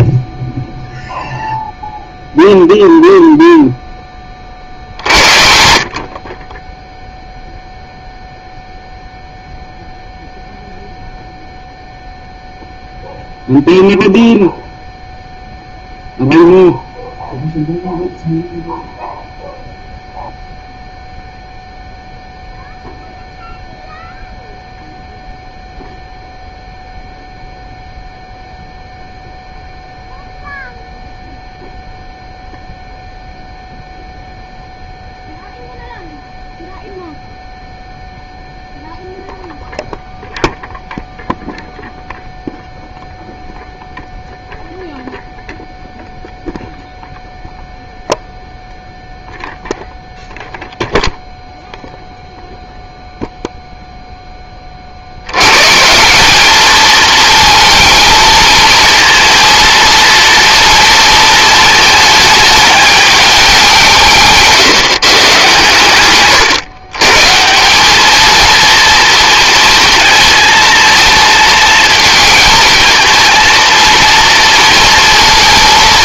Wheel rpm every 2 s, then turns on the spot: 0, 0, 50, 10, 0, 0, 0, 0, 0, 0, 0, 0, 0, 0, 0, 0, 0, 0, 0, 0, 0, 0, 0, 0, 0, 0, 0, 40, 220, 230, 230, 210, 140, 130, 230, 220, 230, 230.
none